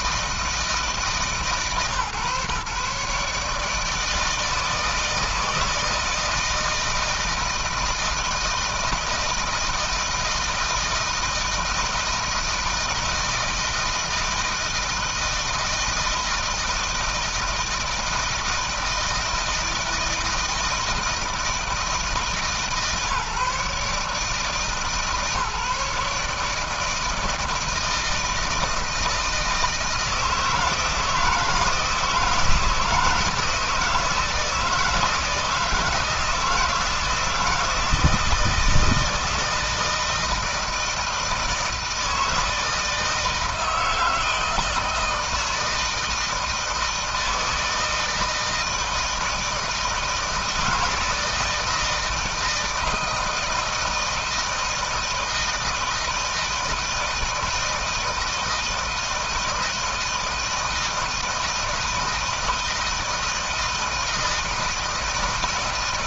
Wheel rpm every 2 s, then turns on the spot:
160, 150, 160, 160, 160, 160, 160, 160, 160, 160, 160, 150, 150, 160, 160, 160, 160, 160, 170, 160, 160, 160, 160, 160, 160, 160, 160, 160, 160, 160, 160, 160, 160.
none